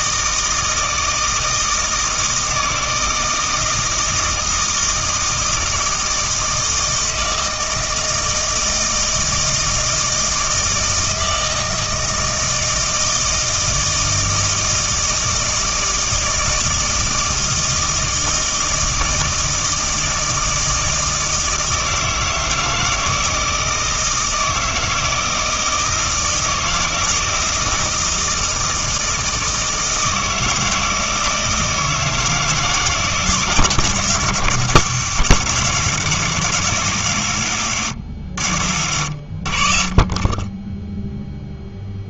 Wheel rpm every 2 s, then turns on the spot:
160, 160, 160, 160, 160, 160, 160, 160, 160, 160, 160, 160, 160, 160, 160, 160, 160, 150, 120, 70, 0.
none